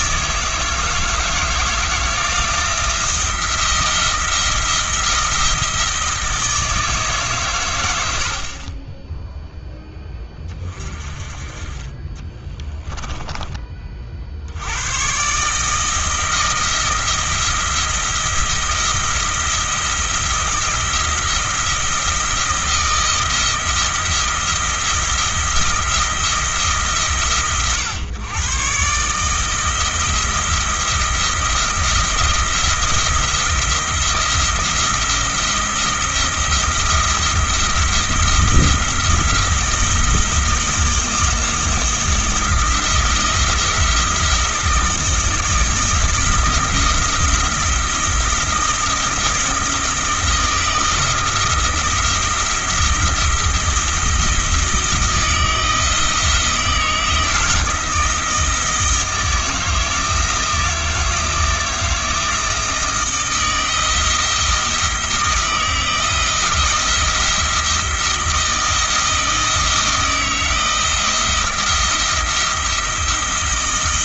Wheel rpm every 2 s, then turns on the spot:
160, 170, 170, 160, 20, 30, 10, 110, 160, 170, 170, 170, 170, 150, 140, 170, 170, 170, 170, 170, 170, 170, 170, 170, 170, 160, 170, 160, 170, 160, 160, 160, 170, 170, 160, 170, 170.
12-14